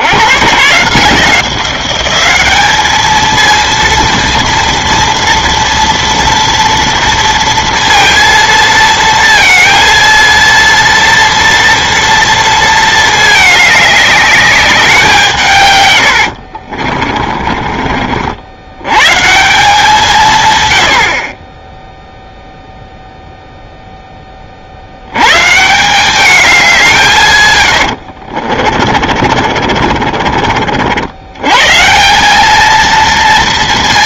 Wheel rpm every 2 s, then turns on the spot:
140, 210, 230, 230, 230, 230, 230, 190, 50, 110, 90, 0, 80, 180, 40, 70, 220.
16-18 28-30